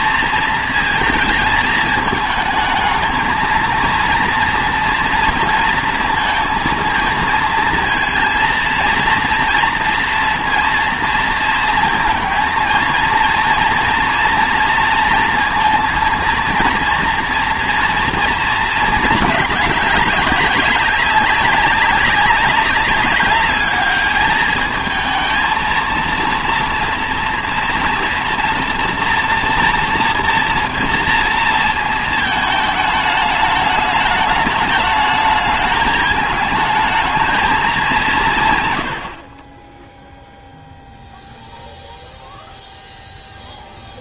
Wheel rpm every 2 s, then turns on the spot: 230, 210, 240, 230, 230, 230, 230, 230, 230, 220, 200, 200, 220, 230, 230, 230, 220, 210, 220, 130, 0, 0.
none